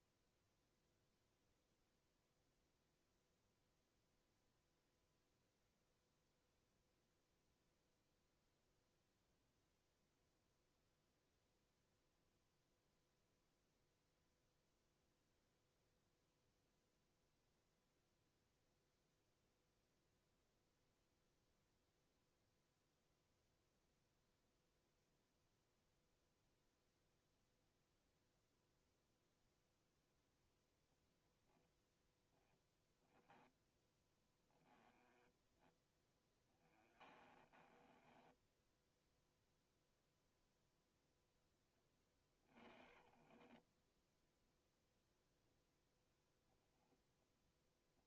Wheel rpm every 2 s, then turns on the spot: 0, 0, 0, 0, 0, 0, 0, 0, 0, 0, 0, 0, 0, 0, 0, 0, 10, 10, 30, 0, 0, 40, 0, 10.
34-38